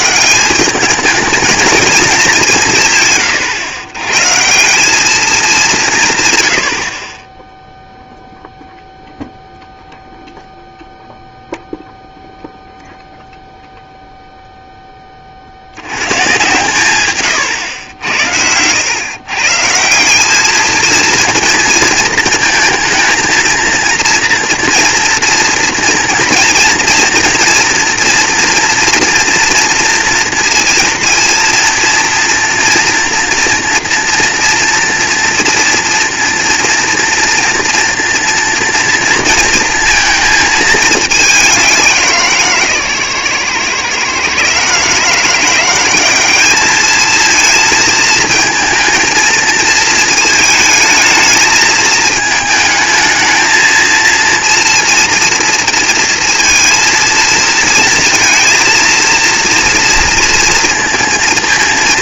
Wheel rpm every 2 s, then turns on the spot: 200, 170, 160, 90, 0, 0, 0, 0, 130, 100, 220, 220, 230, 230, 230, 230, 230, 230, 230, 230, 220, 140, 140, 210, 230, 220, 220, 230, 230, 230, 230.
none